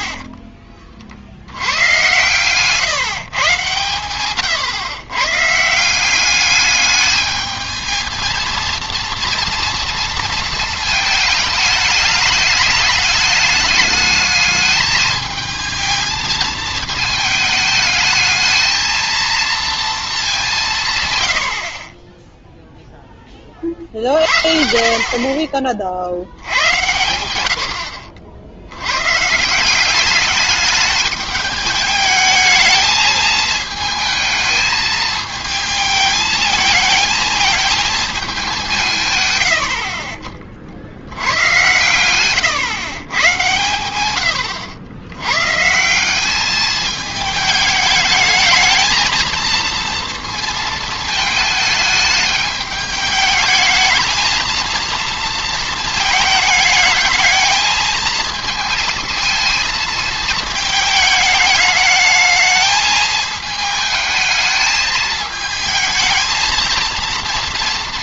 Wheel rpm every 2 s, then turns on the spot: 30, 130, 130, 200, 230, 220, 210, 210, 220, 220, 160, 0, 50, 80, 80, 210, 220, 220, 220, 180, 40, 120, 100, 210, 220, 230, 210, 230, 210, 220, 220, 220, 220, 220.
2-4